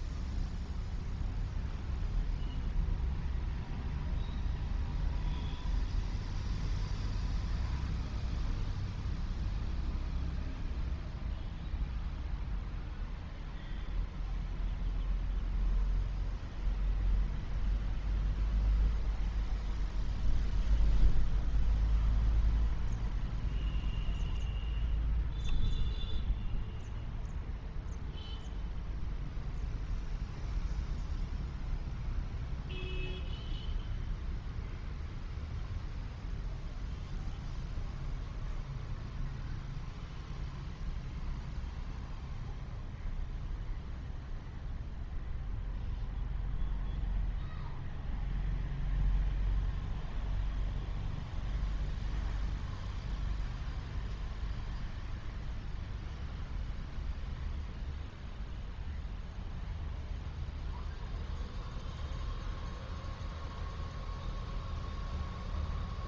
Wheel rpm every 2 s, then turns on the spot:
0, 0, 0, 0, 0, 0, 0, 0, 0, 0, 0, 0, 0, 0, 0, 0, 0, 0, 0, 0, 0, 0, 0, 0, 0, 0, 0, 0, 0, 0, 0, 0, 0.
none